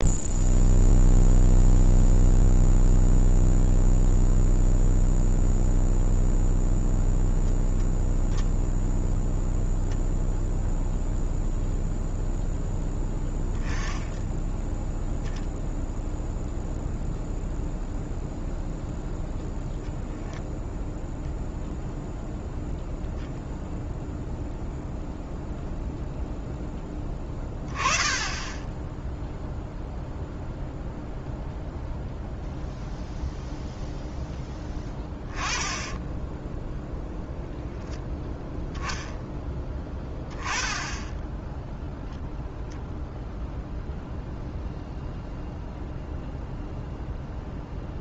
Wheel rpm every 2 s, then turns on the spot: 0, 0, 0, 0, 0, 0, 10, 10, 0, 0, 0, 0, 0, 10, 10, 0, 0, 10, 0, 0, 10, 0, 0, 0.
12-14